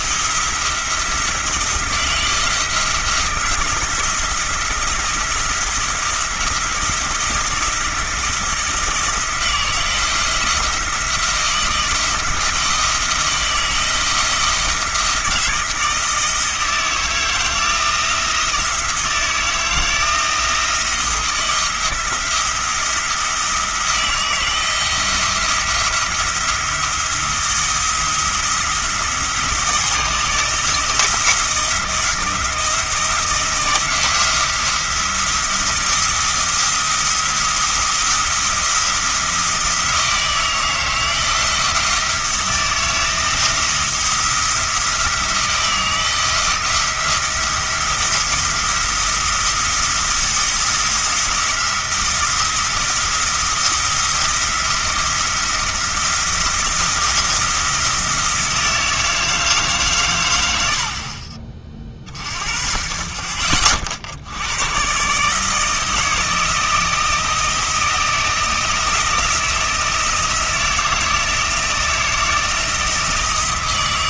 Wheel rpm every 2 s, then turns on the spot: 170, 170, 170, 170, 160, 160, 160, 170, 160, 160, 170, 170, 170, 170, 160, 170, 160, 170, 170, 170, 160, 160, 170, 170, 170, 170, 170, 170, 170, 160, 60, 40, 120, 160, 170, 160, 160.
none